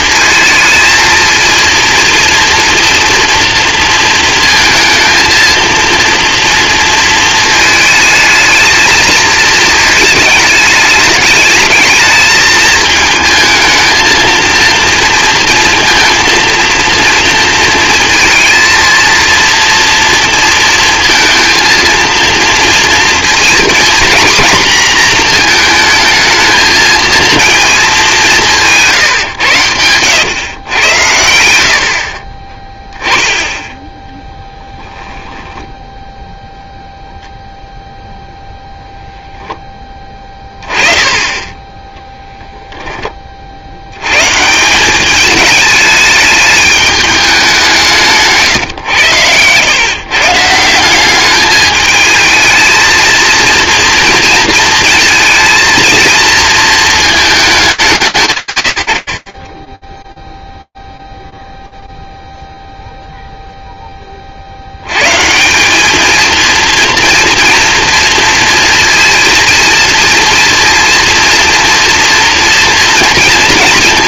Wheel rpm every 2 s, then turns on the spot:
230, 230, 230, 230, 220, 210, 220, 230, 230, 230, 230, 230, 240, 220, 160, 110, 10, 10, 0, 0, 20, 10, 160, 210, 140, 170, 220, 220, 220, 120, 0, 0, 100, 230, 230, 230, 230.
34-36